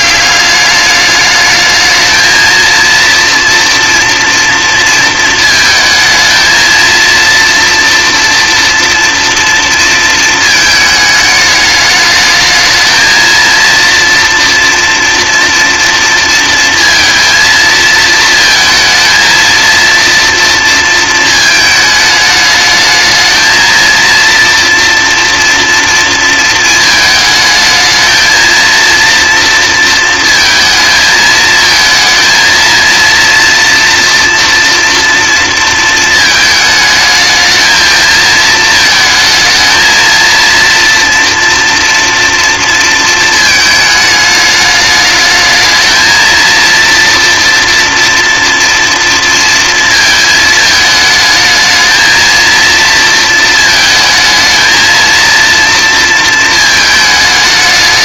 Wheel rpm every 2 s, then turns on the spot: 200, 230, 230, 220, 230, 220, 220, 230, 230, 220, 230, 220, 230, 220, 230, 220, 230, 230, 220, 220, 230, 230, 210, 230, 230, 220, 230, 220, 220.
none